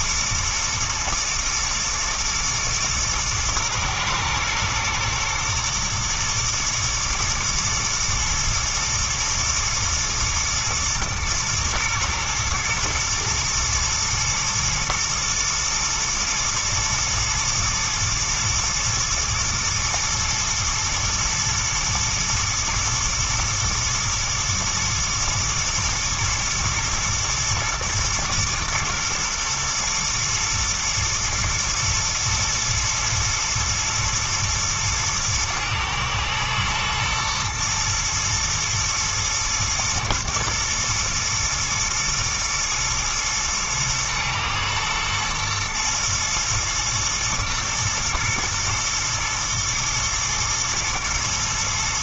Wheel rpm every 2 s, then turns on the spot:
120, 120, 120, 110, 110, 120, 120, 110, 120, 120, 110, 110, 110, 110, 110, 120, 120, 110, 120, 110, 110, 110, 110, 110, 110, 120.
none